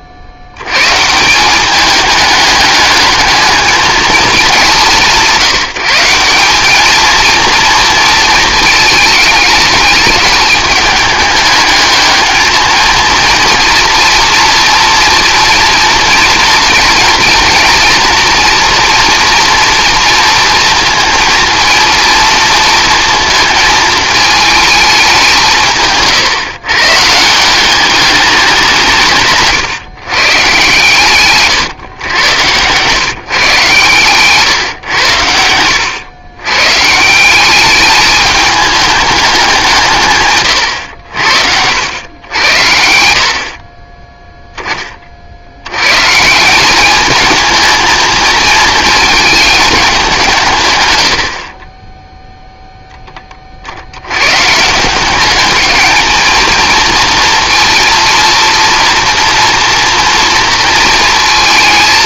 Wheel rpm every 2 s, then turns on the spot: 130, 210, 200, 200, 220, 210, 220, 230, 230, 230, 230, 230, 210, 130, 180, 140, 130, 130, 130, 210, 100, 80, 20, 190, 230, 130, 0, 160, 230, 230, 230.
none